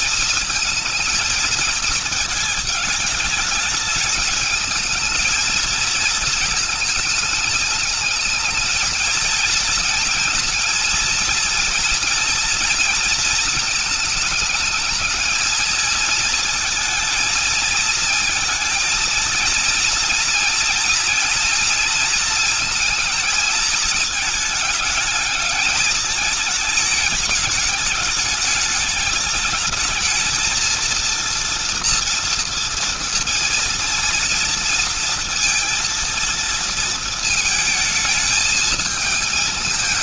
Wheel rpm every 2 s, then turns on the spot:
230, 220, 220, 220, 220, 230, 230, 210, 220, 220, 230, 230, 210, 210, 210, 220, 230, 230, 230, 220.
none